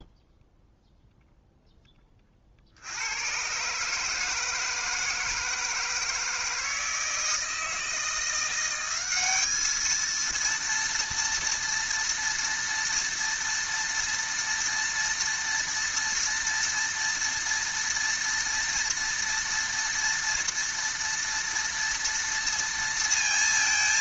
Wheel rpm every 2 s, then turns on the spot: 0, 60, 160, 160, 180, 230, 230, 230, 230, 230, 230, 230.
none